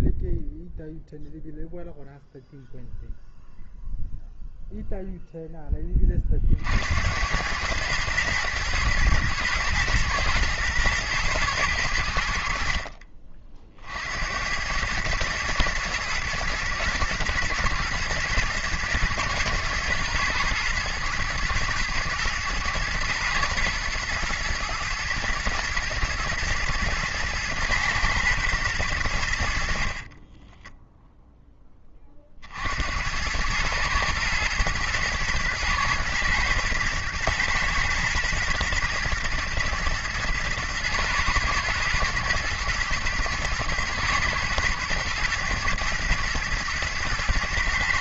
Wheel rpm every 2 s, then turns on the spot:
0, 0, 50, 110, 110, 60, 90, 110, 110, 110, 120, 120, 120, 110, 10, 40, 120, 120, 120, 110, 110, 120, 110, 110.
28-30